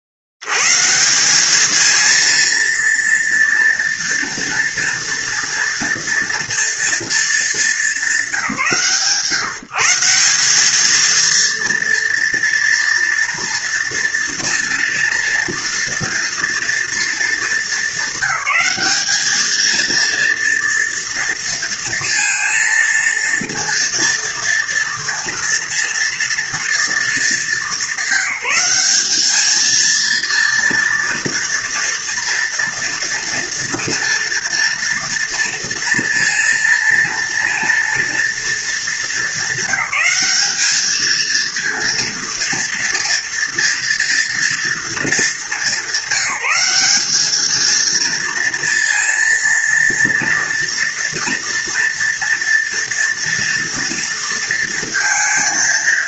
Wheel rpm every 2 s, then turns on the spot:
60, 230, 230, 230, 190, 200, 240, 230, 230, 200, 230, 230, 230, 230, 200, 230, 230, 230, 230, 230, 210, 230, 230, 190, 230, 230, 230, 230.
none